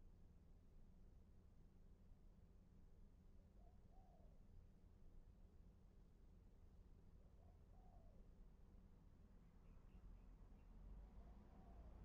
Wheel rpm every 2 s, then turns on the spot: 0, 0, 0, 0, 0, 0.
none